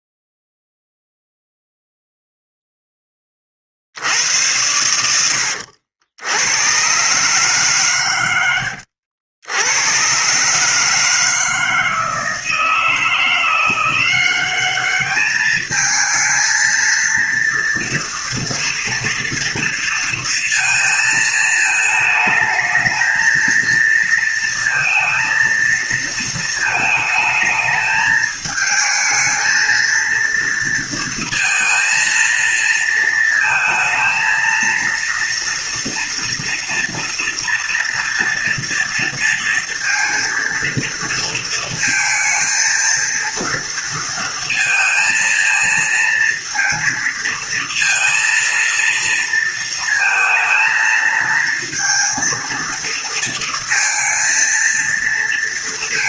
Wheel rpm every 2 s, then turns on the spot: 0, 0, 80, 90, 100, 140, 160, 190, 220, 230, 230, 220, 230, 220, 220, 230, 230, 230, 230, 230, 230, 230, 230, 230, 230, 220, 230, 230.
none